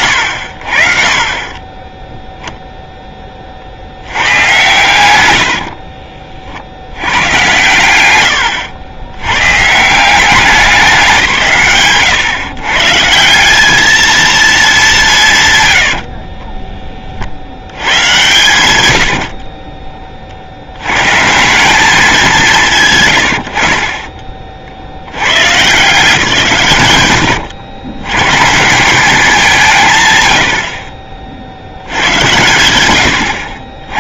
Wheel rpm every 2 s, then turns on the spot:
10, 0, 110, 90, 80, 180, 140, 200, 30, 80, 110, 170, 70, 130, 180, 30, 90.
4-6 8-10 18-20